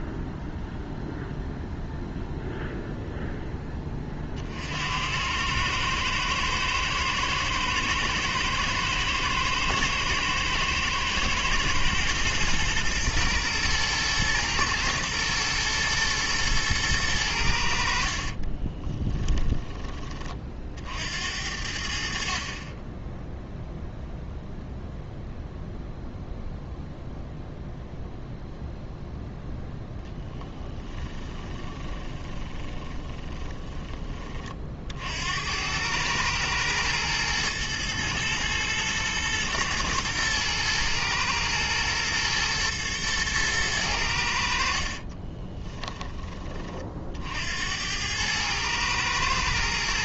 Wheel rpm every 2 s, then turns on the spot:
0, 0, 70, 110, 110, 110, 120, 110, 110, 20, 60, 20, 0, 0, 0, 10, 20, 50, 110, 110, 120, 110, 60, 40, 110.
18-20 30-34 44-46